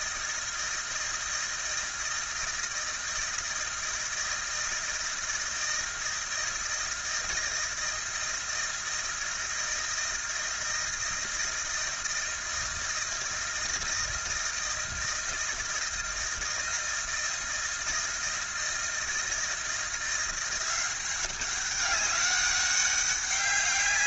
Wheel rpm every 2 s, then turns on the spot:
160, 160, 160, 160, 160, 160, 160, 160, 160, 160, 180, 200.
none